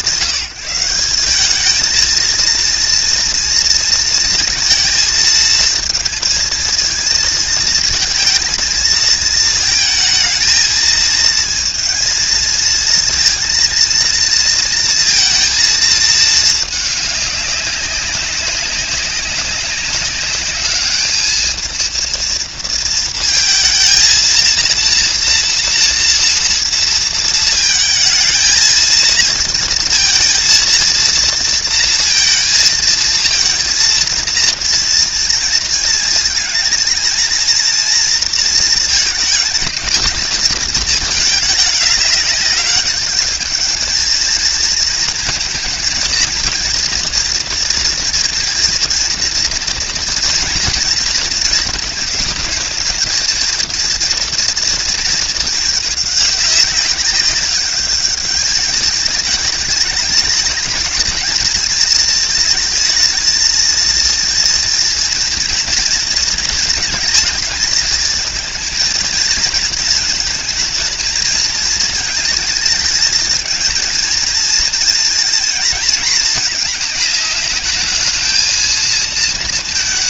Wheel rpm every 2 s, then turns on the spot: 180, 230, 230, 220, 230, 220, 220, 230, 210, 190, 210, 230, 230, 230, 220, 230, 220, 230, 230, 230, 210, 200, 220, 230, 230, 230, 220, 230, 200, 210, 210, 220, 230, 220, 220, 220, 220, 230, 210, 230.
none